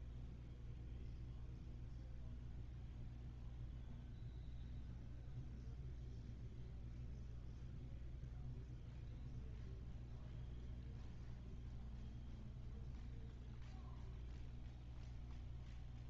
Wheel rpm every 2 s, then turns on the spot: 0, 0, 0, 0, 0, 0, 0, 0.
none